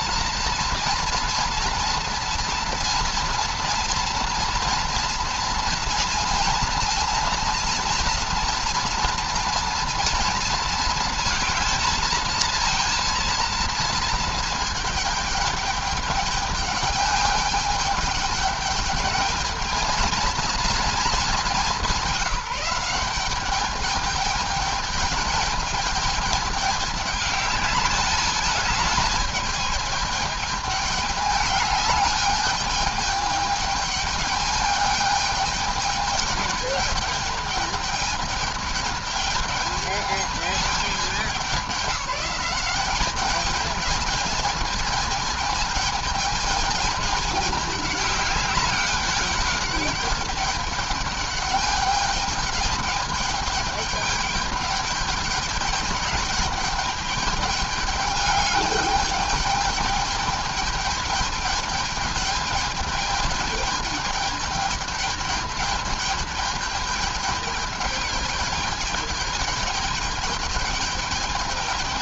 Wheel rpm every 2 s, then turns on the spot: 240, 240, 230, 230, 240, 230, 230, 230, 210, 210, 220, 190, 220, 210, 210, 210, 210, 210, 210, 210, 210, 200, 220, 220, 210, 210, 210, 210, 210, 210, 210, 210, 210, 210, 210, 210.
none